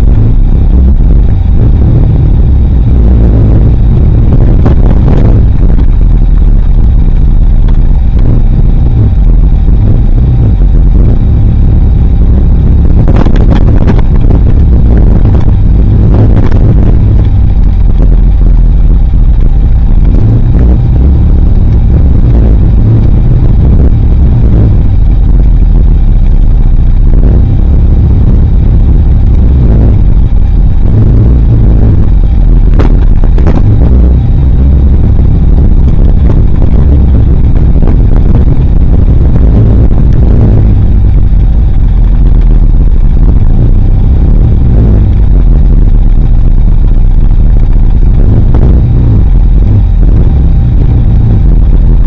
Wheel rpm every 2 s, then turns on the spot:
0, 0, 0, 0, 0, 0, 0, 0, 0, 0, 0, 0, 0, 0, 0, 0, 0, 0, 0, 0, 0, 0, 0, 0, 0, 0.
none